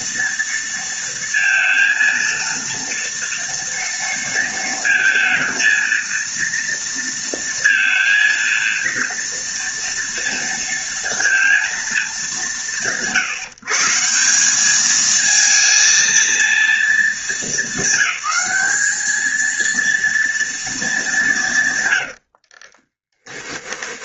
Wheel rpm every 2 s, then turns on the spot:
230, 230, 230, 230, 230, 230, 150, 210, 220, 210, 200, 20.
22-24